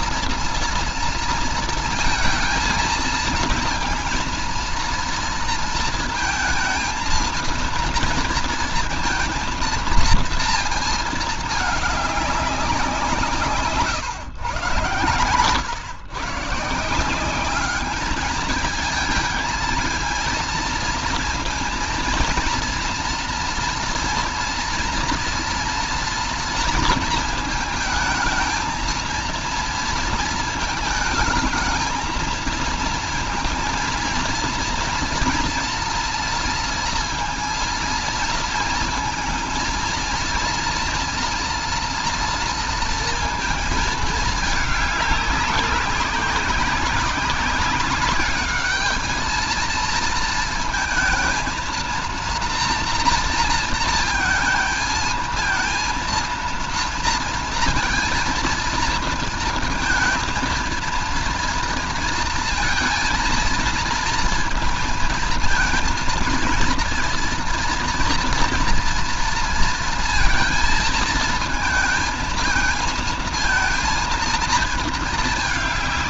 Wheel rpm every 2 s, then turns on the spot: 230, 230, 230, 220, 230, 230, 190, 120, 150, 220, 230, 230, 230, 230, 220, 220, 220, 230, 240, 230, 230, 230, 210, 190, 200, 230, 230, 220, 230, 230, 230, 230, 230, 230, 230, 230, 230, 230.
none